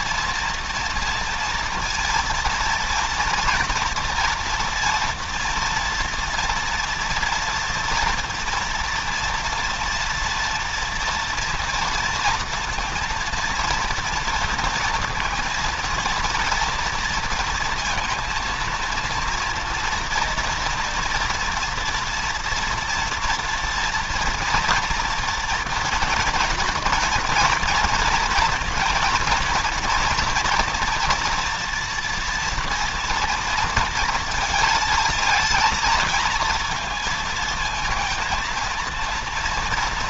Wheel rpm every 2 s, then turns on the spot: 230, 230, 230, 230, 240, 240, 230, 230, 230, 230, 230, 230, 230, 230, 230, 230, 240, 230, 230, 230.
none